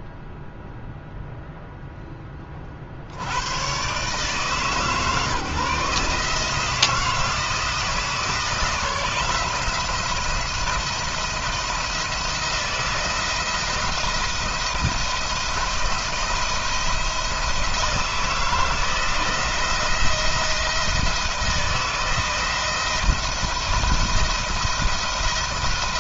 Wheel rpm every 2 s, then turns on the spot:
0, 40, 150, 160, 160, 170, 170, 170, 170, 170, 160, 170, 170.
none